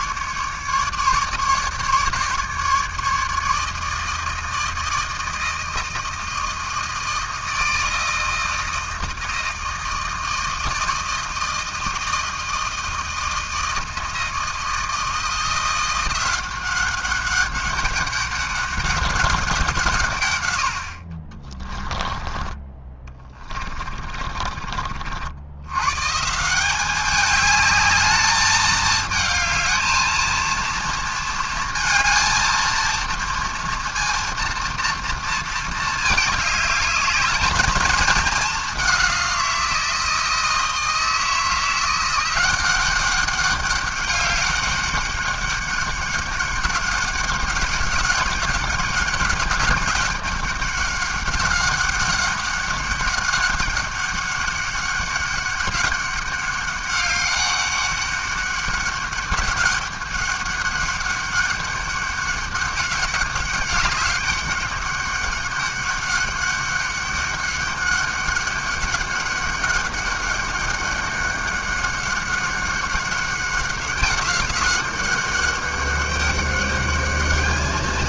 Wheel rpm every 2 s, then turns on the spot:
150, 150, 160, 160, 160, 160, 160, 160, 190, 190, 100, 20, 40, 180, 220, 230, 230, 230, 210, 200, 160, 180, 200, 200, 200, 200, 200, 200, 200, 200, 200, 200, 200, 200, 200, 200, 190, 190, 200.
24-26